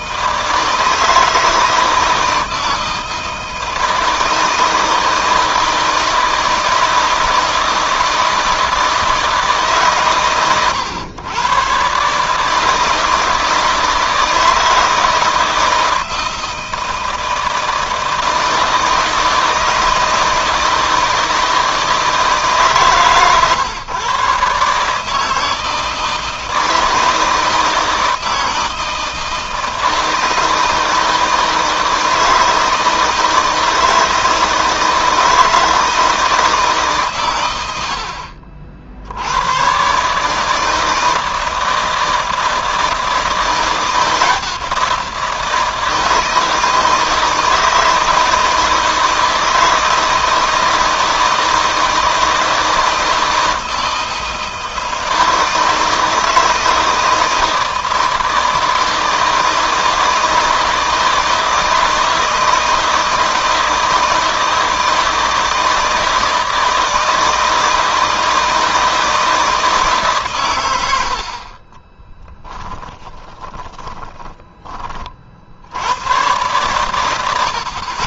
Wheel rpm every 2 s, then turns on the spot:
160, 160, 160, 160, 160, 110, 160, 160, 160, 160, 160, 140, 150, 160, 160, 160, 160, 160, 140, 70, 160, 170, 170, 160, 160, 160, 160, 160, 160, 160, 160, 160, 160, 160, 160, 80, 20, 40, 100.
72-74